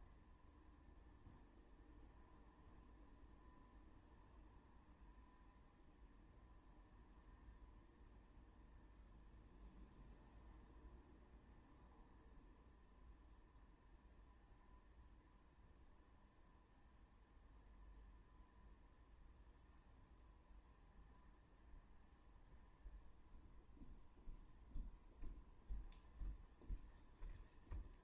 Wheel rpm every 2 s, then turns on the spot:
0, 0, 0, 0, 0, 0, 0, 0, 0, 0, 0, 0, 0, 0.
none